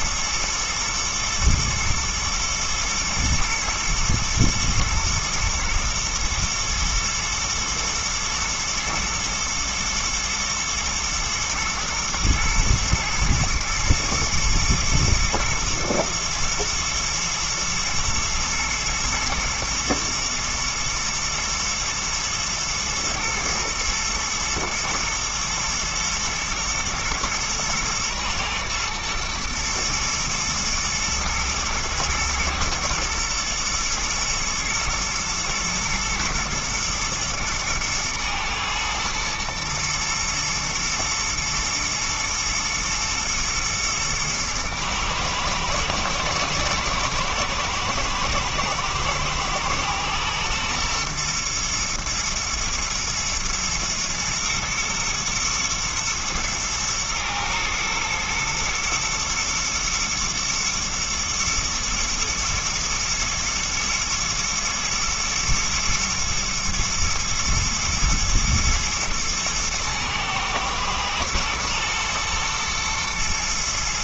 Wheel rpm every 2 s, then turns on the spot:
110, 120, 120, 110, 120, 110, 110, 120, 110, 120, 110, 110, 110, 120, 110, 110, 120, 120, 110, 110, 110, 110, 110, 110, 110, 120, 110, 110, 110, 120, 120, 110, 110, 120, 120, 110, 120.
none